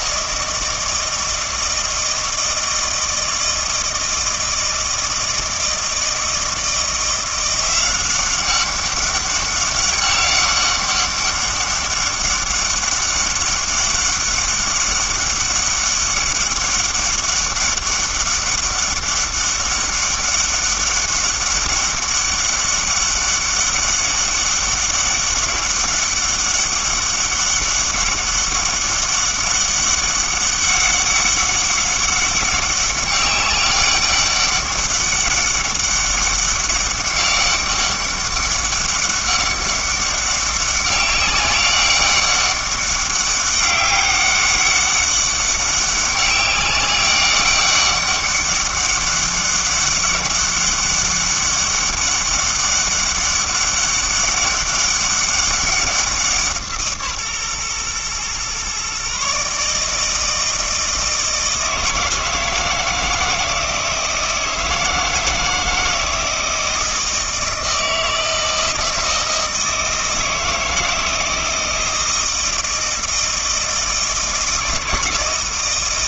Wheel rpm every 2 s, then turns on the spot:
160, 160, 160, 170, 190, 200, 200, 200, 200, 200, 200, 200, 200, 200, 200, 200, 200, 200, 200, 200, 200, 200, 200, 200, 200, 200, 200, 200, 170, 130, 160, 160, 160, 160, 160, 160, 160, 160.
none